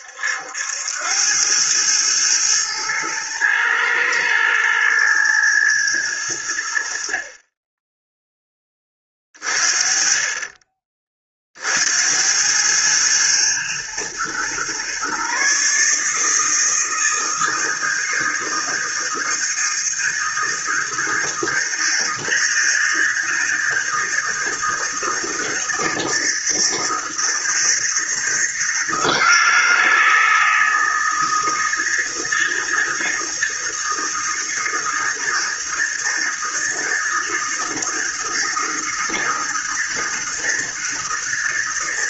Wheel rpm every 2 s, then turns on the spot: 80, 110, 110, 90, 20, 30, 100, 120, 160, 160, 160, 160, 160, 160, 160, 160, 160, 160, 160, 160, 160.
none